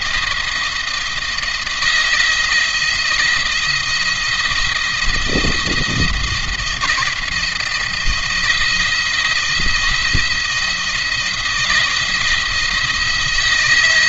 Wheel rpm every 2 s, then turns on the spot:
170, 170, 160, 170, 160, 160, 160.
none